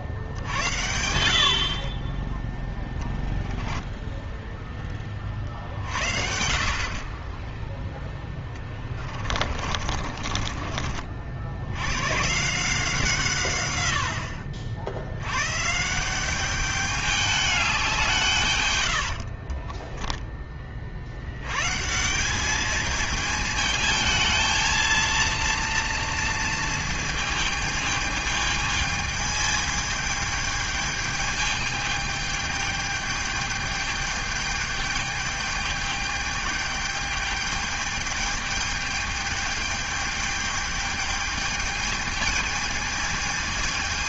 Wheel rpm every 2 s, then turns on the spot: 70, 10, 10, 50, 10, 40, 150, 70, 190, 130, 30, 210, 220, 230, 220, 210, 210, 210, 210, 210, 210, 220.
8-12 18-20